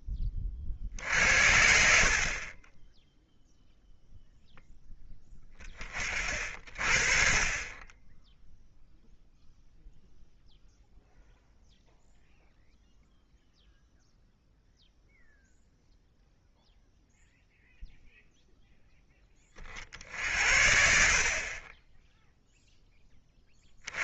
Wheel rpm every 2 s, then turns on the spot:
40, 30, 0, 60, 0, 0, 0, 0, 0, 0, 70, 0.
none